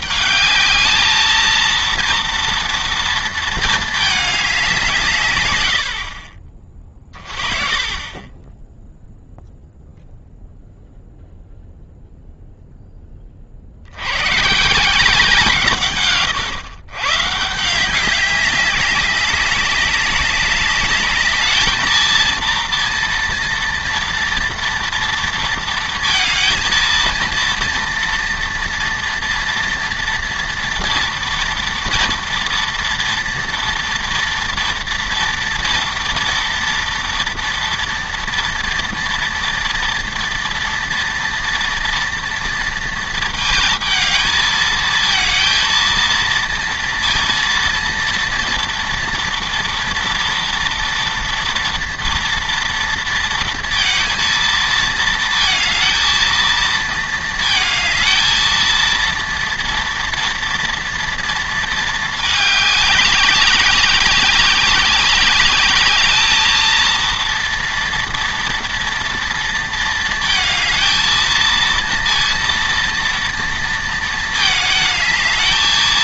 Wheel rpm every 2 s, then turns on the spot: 220, 230, 210, 40, 10, 0, 0, 150, 120, 200, 200, 230, 230, 220, 230, 230, 230, 230, 230, 230, 230, 230, 220, 230, 230, 230, 230, 230, 230, 230, 230, 200, 190, 220, 230, 230, 230, 220.
6-8